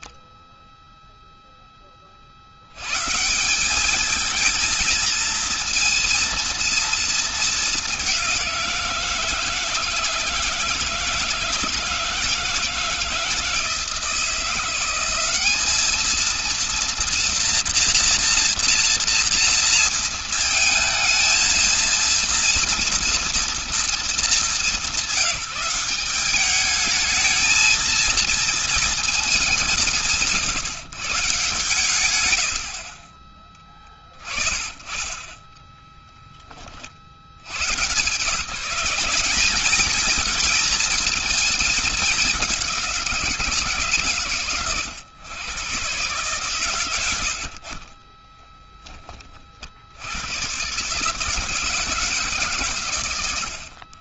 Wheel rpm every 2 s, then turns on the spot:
0, 130, 230, 230, 160, 160, 160, 180, 230, 230, 220, 230, 200, 220, 220, 150, 50, 20, 40, 170, 220, 190, 100, 120, 10, 110, 150.
none